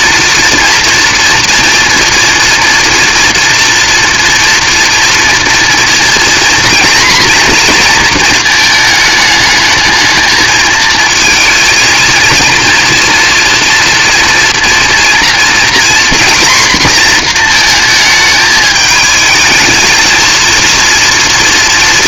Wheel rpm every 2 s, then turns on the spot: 230, 230, 230, 240, 220, 220, 230, 230, 240, 210, 230.
none